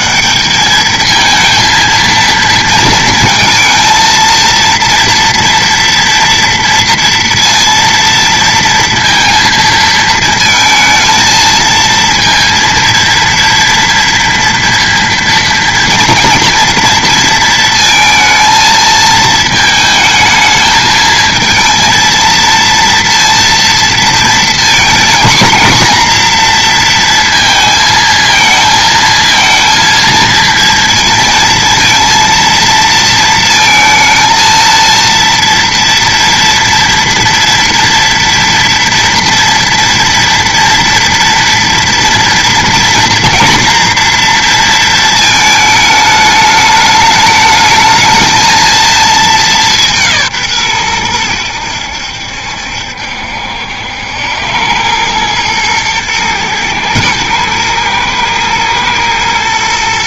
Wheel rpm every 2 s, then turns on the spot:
220, 230, 230, 230, 230, 230, 230, 230, 230, 220, 220, 230, 230, 230, 220, 230, 230, 230, 230, 230, 230, 230, 230, 210, 220, 110, 70, 100, 110, 120.
none